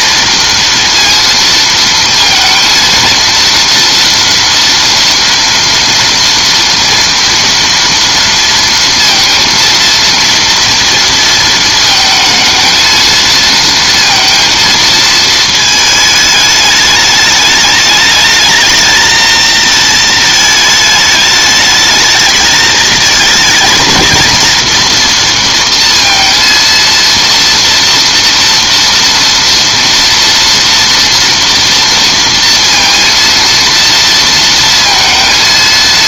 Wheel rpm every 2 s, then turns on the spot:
230, 230, 230, 230, 230, 230, 220, 230, 210, 220, 220, 220, 230, 230, 230, 230, 230, 230.
none